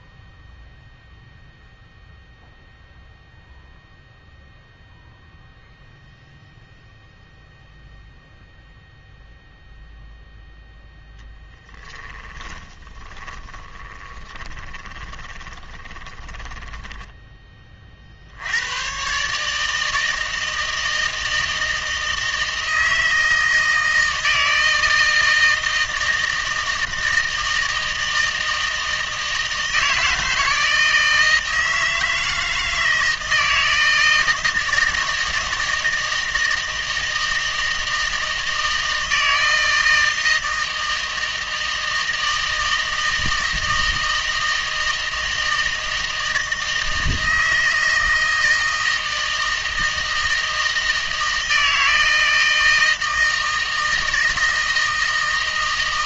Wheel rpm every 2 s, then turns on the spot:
0, 0, 0, 0, 0, 0, 20, 20, 10, 100, 160, 160, 160, 160, 160, 160, 160, 160, 160, 160, 160, 160, 160, 160, 160, 160, 160, 160.
12-18